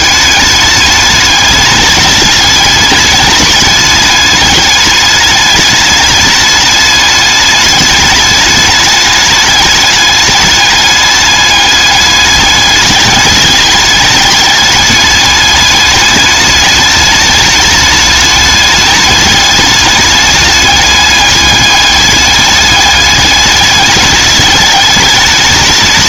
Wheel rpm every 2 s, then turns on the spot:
210, 210, 210, 210, 210, 210, 210, 210, 210, 210, 210, 210, 210.
none